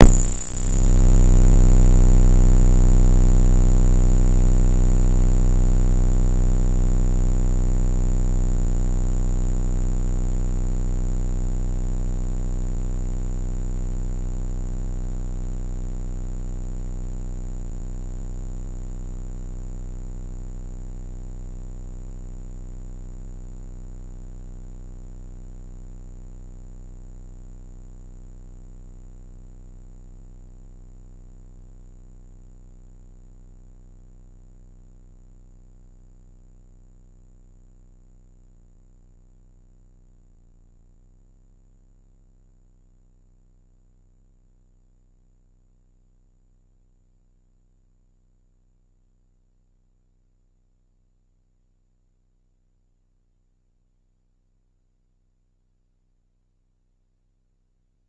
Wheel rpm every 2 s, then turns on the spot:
0, 0, 0, 0, 0, 0, 0, 0, 0, 0, 0, 0, 0, 0, 0, 0, 0, 0, 0, 0, 0, 0, 0, 0, 0, 0, 0, 0, 0.
none